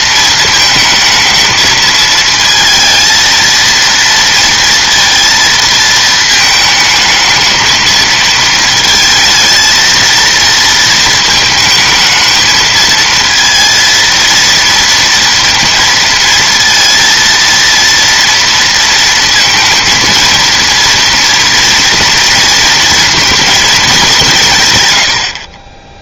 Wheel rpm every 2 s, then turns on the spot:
220, 230, 230, 220, 220, 230, 230, 230, 230, 230, 230, 230, 130.
none